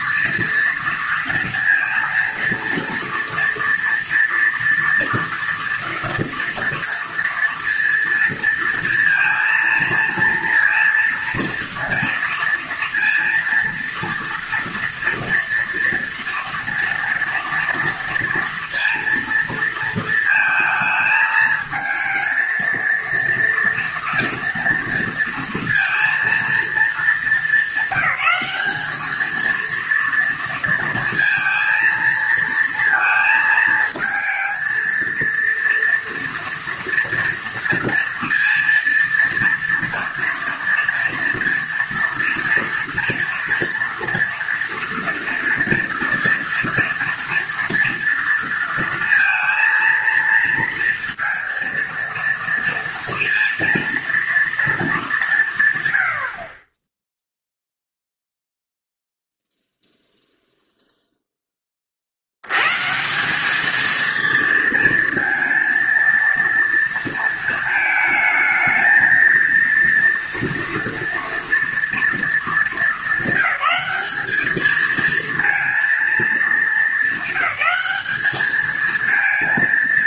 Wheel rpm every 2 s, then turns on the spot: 230, 230, 230, 230, 230, 230, 230, 230, 230, 230, 220, 230, 230, 230, 200, 230, 230, 220, 230, 240, 230, 230, 230, 230, 230, 230, 230, 220, 30, 0, 0, 110, 230, 230, 220, 230, 220, 210, 220, 210.
none